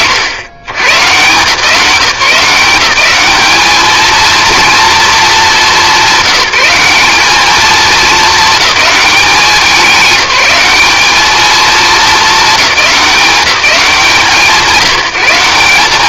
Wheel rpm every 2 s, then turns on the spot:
120, 190, 230, 190, 210, 190, 210, 160.
none